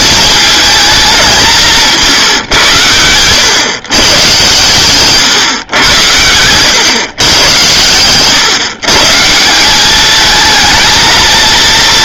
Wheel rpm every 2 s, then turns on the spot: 210, 120, 130, 110, 140, 220.
6-8